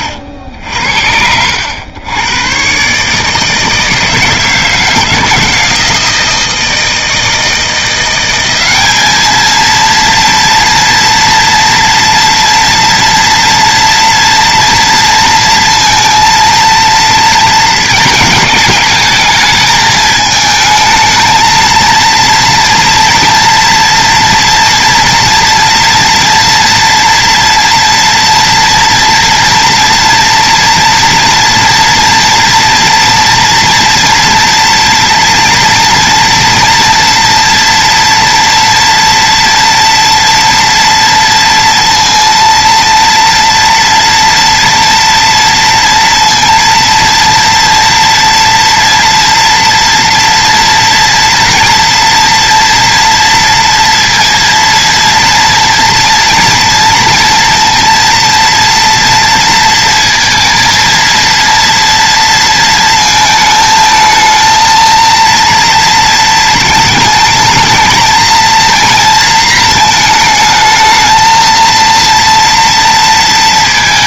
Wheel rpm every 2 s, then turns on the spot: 70, 120, 160, 160, 190, 230, 230, 230, 230, 220, 220, 230, 240, 230, 230, 230, 230, 230, 230, 230, 230, 230, 230, 230, 230, 230, 230, 230, 230, 230, 230, 230, 230, 220, 230, 220, 230.
none